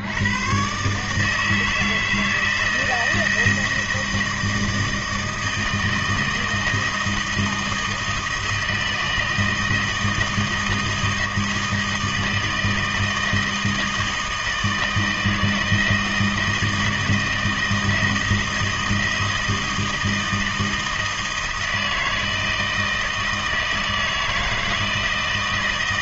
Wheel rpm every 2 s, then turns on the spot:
120, 160, 160, 160, 160, 160, 160, 160, 160, 160, 160, 160, 160.
none